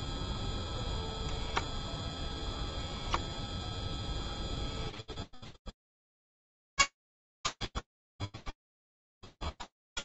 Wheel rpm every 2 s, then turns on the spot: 0, 0, 0, 40, 10.
8-10